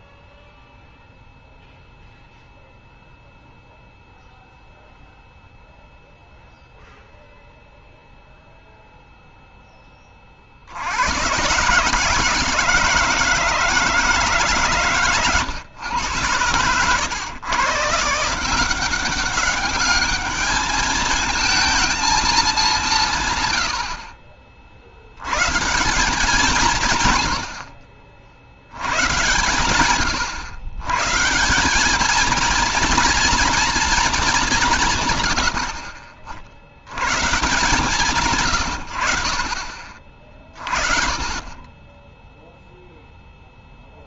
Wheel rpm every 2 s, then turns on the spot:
0, 0, 0, 0, 0, 60, 160, 140, 110, 170, 220, 200, 70, 170, 100, 130, 230, 170, 60, 120, 30, 0.
none